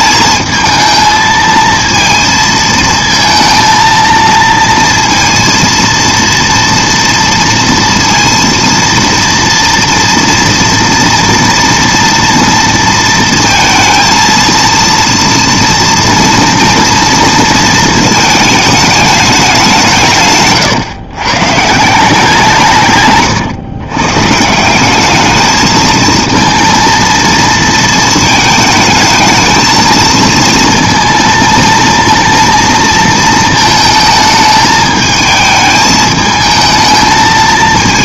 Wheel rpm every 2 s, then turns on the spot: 220, 230, 230, 230, 230, 230, 230, 230, 230, 220, 140, 180, 150, 230, 220, 230, 230, 220, 220.
none